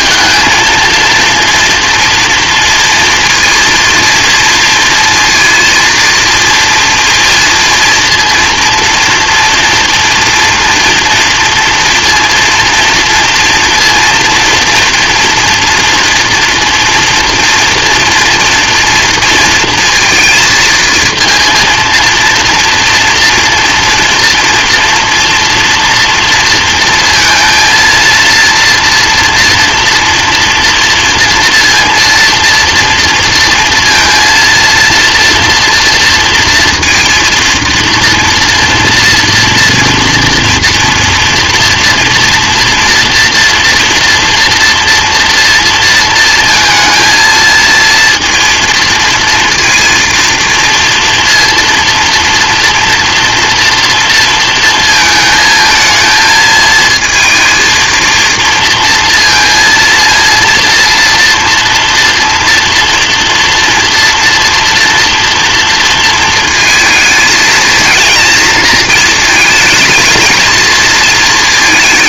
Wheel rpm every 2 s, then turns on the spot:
220, 230, 230, 230, 240, 230, 240, 230, 230, 230, 220, 230, 230, 230, 230, 230, 230, 230, 230, 230, 230, 230, 230, 220, 230, 230, 230, 230, 230, 230, 230, 230, 230, 220, 230, 220.
none